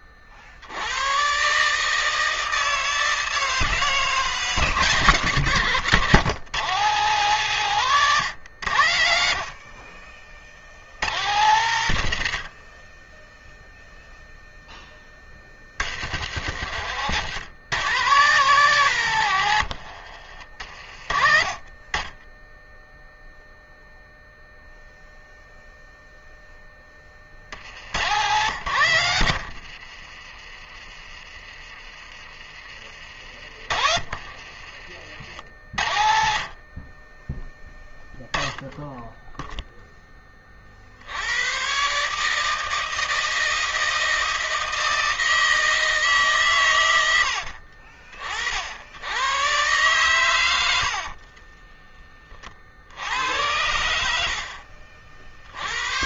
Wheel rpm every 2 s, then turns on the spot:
40, 160, 150, 130, 130, 50, 70, 0, 90, 140, 70, 20, 0, 10, 80, 30, 30, 60, 50, 10, 30, 150, 160, 120, 50, 90, 40, 70.
8-10 28-32 34-36 54-56